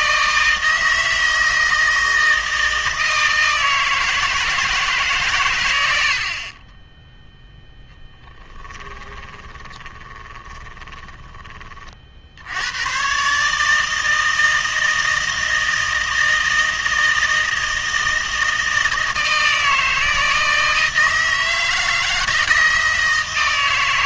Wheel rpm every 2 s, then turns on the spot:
160, 160, 160, 20, 10, 20, 90, 160, 160, 160, 160, 160.
8-12